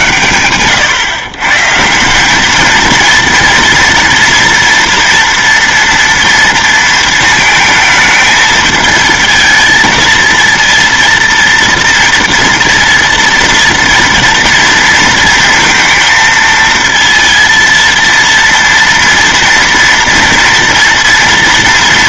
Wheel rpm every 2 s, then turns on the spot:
120, 220, 230, 230, 220, 230, 230, 230, 230, 240, 230.
none